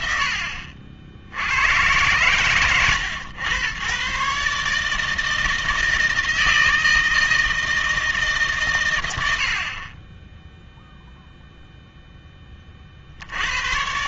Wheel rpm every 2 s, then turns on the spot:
80, 120, 150, 160, 140, 0, 30.
none